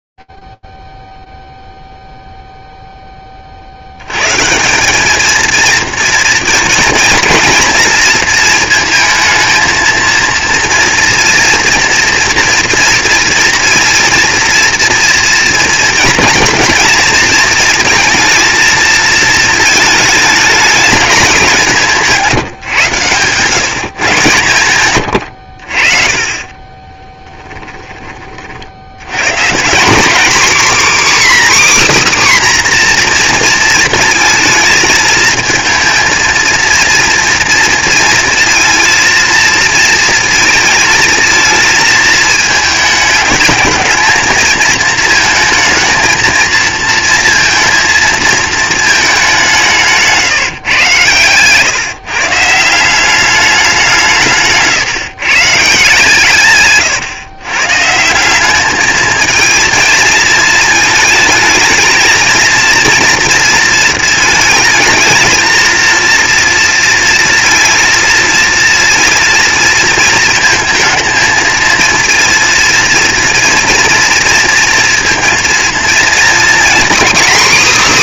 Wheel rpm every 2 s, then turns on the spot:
0, 0, 150, 220, 220, 230, 230, 230, 230, 220, 220, 170, 120, 30, 70, 270, 260, 220, 230, 230, 220, 220, 220, 230, 220, 130, 170, 150, 130, 210, 220, 230, 220, 230, 230, 220, 230, 230, 250.
22-24 26-28